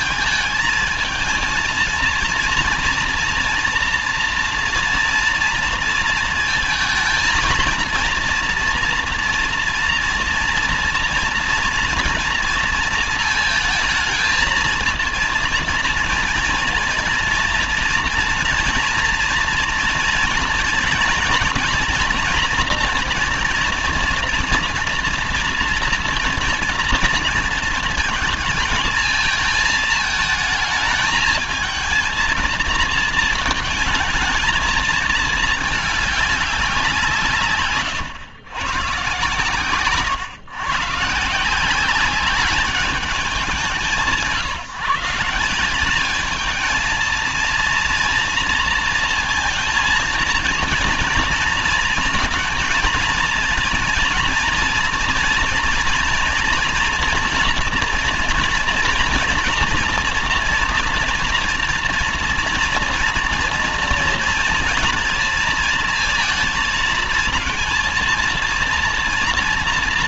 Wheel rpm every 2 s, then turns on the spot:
220, 230, 230, 220, 230, 230, 230, 230, 240, 230, 230, 240, 240, 230, 220, 220, 220, 220, 190, 120, 140, 200, 170, 220, 230, 230, 230, 230, 230, 230, 230, 230, 230, 230, 230.
none